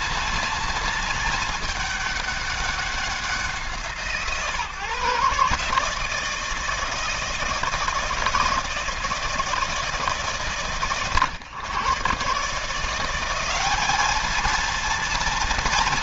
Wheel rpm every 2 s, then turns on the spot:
230, 200, 140, 160, 160, 130, 170, 230.
none